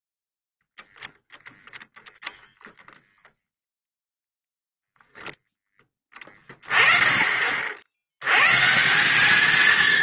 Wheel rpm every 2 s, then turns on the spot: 0, 20, 0, 30, 140.
none